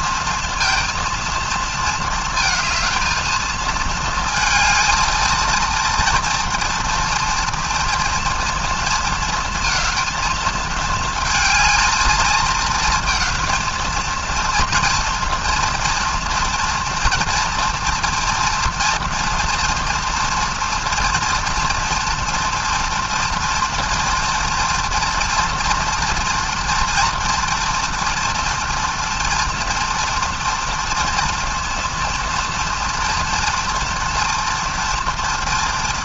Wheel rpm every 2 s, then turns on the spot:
230, 220, 220, 230, 230, 220, 220, 230, 230, 230, 230, 230, 230, 230, 230, 230, 230, 240.
none